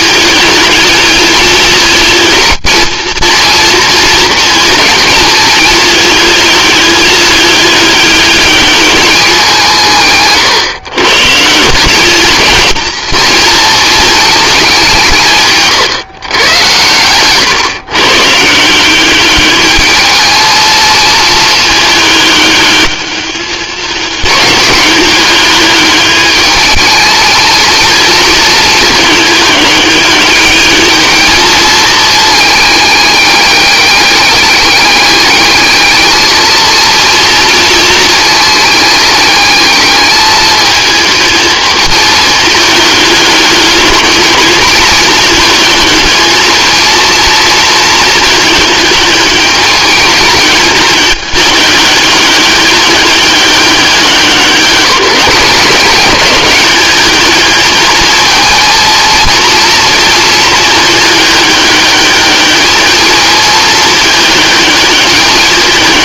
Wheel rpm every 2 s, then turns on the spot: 220, 230, 220, 210, 210, 140, 230, 180, 110, 190, 220, 210, 210, 220, 210, 210, 210, 200, 230, 210, 220, 210, 220, 230, 220, 210, 200, 190, 210, 230, 220, 220, 210.
none